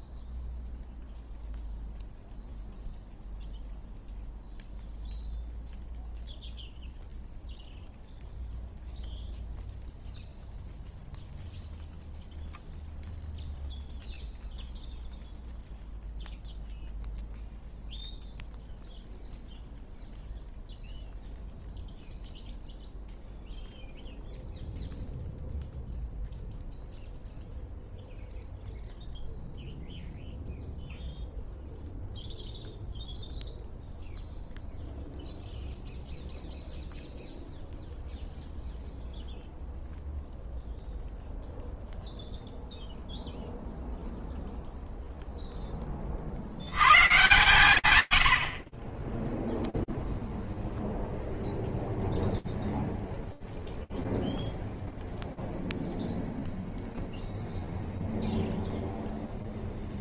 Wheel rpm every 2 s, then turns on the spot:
0, 0, 0, 0, 0, 0, 0, 0, 0, 0, 0, 0, 0, 0, 0, 0, 0, 0, 0, 0, 0, 0, 0, 130, 40, 0, 0, 0, 0, 0.
none